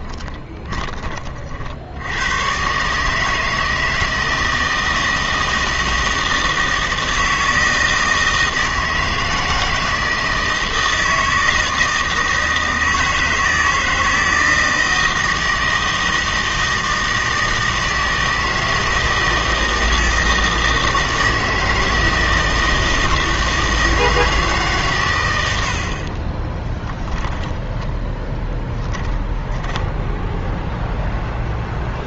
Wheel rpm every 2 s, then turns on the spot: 20, 130, 160, 160, 160, 160, 160, 160, 160, 160, 160, 160, 150, 10, 10, 0.
0-2 26-30